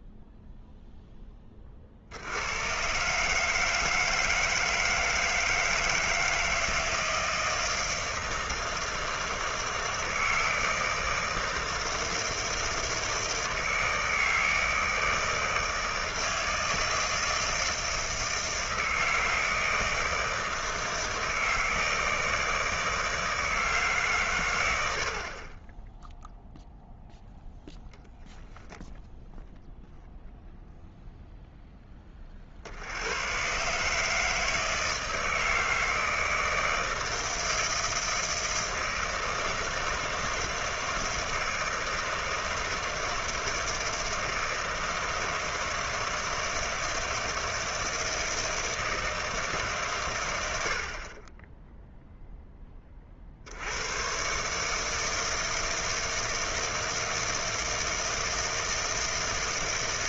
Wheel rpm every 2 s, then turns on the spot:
0, 110, 160, 160, 160, 160, 160, 160, 160, 160, 160, 160, 100, 0, 0, 0, 50, 160, 160, 160, 160, 160, 160, 160, 160, 70, 10, 150, 160, 160.
none